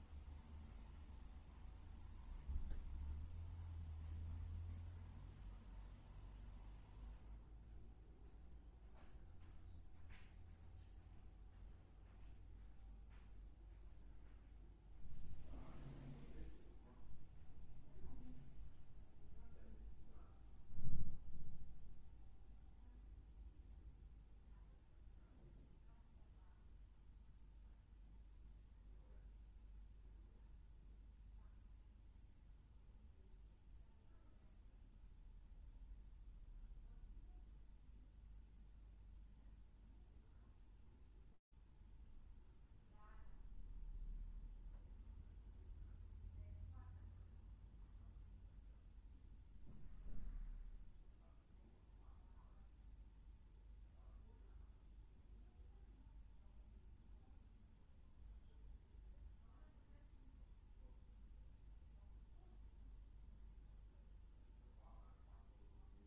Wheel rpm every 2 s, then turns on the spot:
0, 0, 0, 0, 0, 0, 0, 0, 0, 0, 0, 0, 0, 0, 0, 0, 0, 0, 0, 0, 0, 0, 0, 0, 0, 0, 0, 0, 0, 0, 0, 0, 0.
none